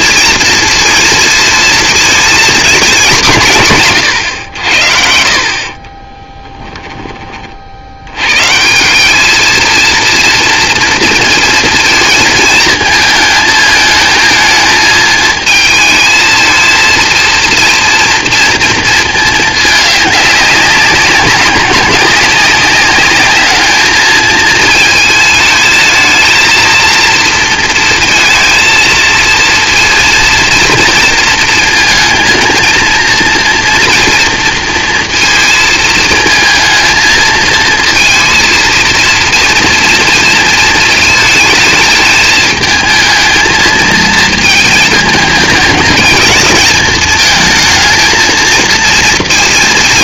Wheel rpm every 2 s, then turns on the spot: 230, 240, 90, 20, 140, 230, 220, 220, 220, 230, 200, 200, 220, 220, 230, 230, 230, 230, 220, 230, 220, 220, 220, 220, 230.
6-8